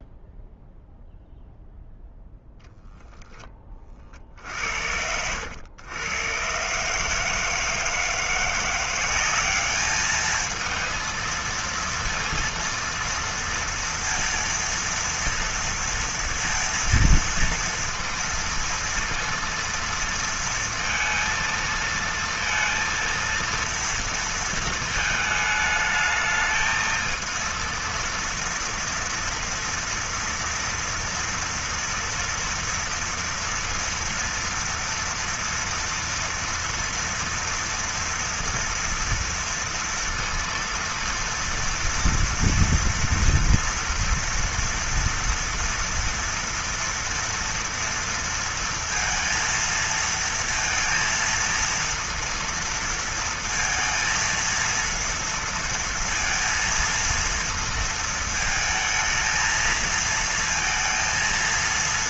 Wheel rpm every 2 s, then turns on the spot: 0, 0, 50, 130, 170, 220, 230, 230, 230, 230, 230, 230, 230, 220, 230, 230, 230, 230, 230, 240, 230, 230, 240, 230, 230, 230, 230, 230, 230, 220, 230.
none